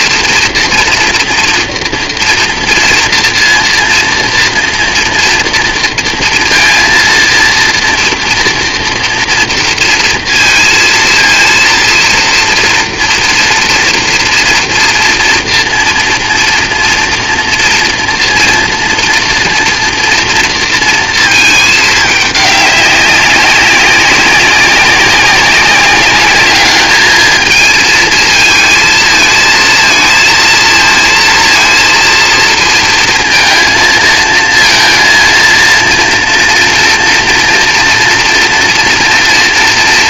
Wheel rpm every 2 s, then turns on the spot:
240, 230, 240, 230, 230, 230, 230, 230, 230, 230, 230, 200, 190, 210, 220, 230, 230, 230, 230, 230.
none